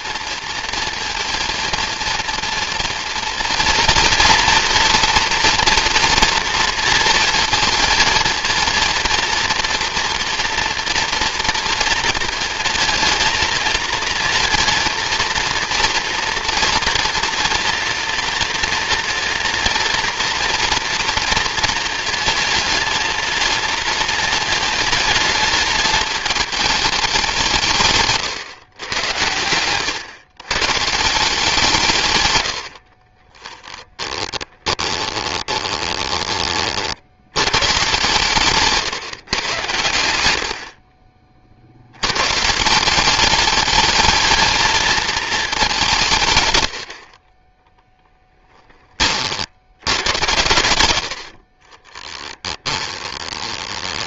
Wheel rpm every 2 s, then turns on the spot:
230, 240, 240, 230, 230, 230, 230, 230, 230, 230, 240, 230, 210, 210, 120, 140, 60, 20, 50, 150, 50, 170, 220, 90, 20, 100, 10.
32-36 52-54